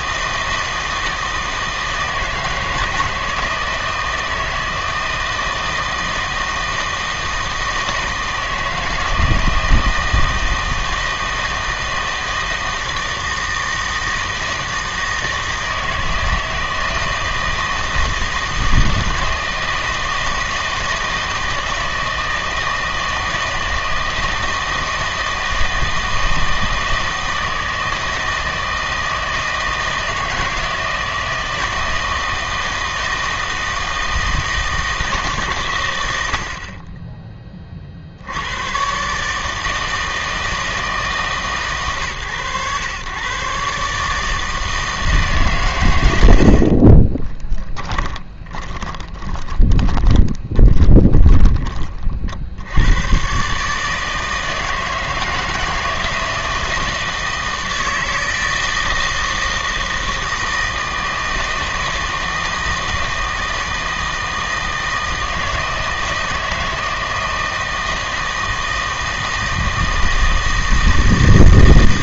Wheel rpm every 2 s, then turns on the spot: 160, 160, 160, 160, 160, 160, 160, 160, 160, 160, 160, 160, 160, 160, 160, 160, 160, 160, 50, 110, 160, 120, 160, 50, 20, 20, 80, 160, 160, 160, 160, 160, 160, 160, 160, 160.
48-52